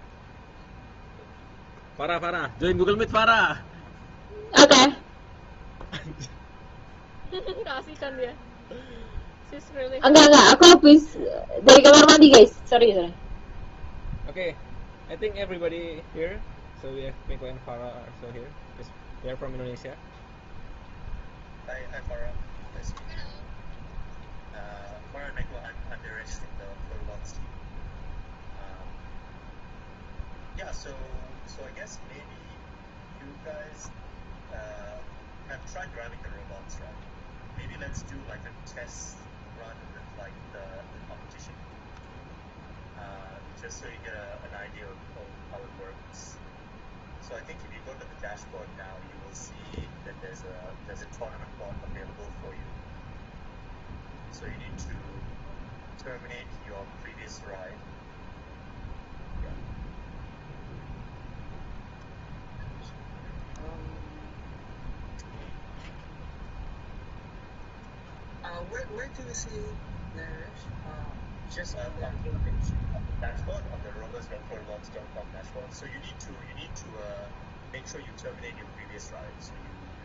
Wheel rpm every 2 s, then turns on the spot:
0, 0, 0, 0, 0, 0, 0, 0, 0, 0, 0, 0, 0, 0, 0, 0, 0, 0, 0, 0, 0, 0, 0, 0, 0, 0, 0, 0, 0, 0, 0, 0, 0, 0, 0, 0, 0, 0, 0, 0.
none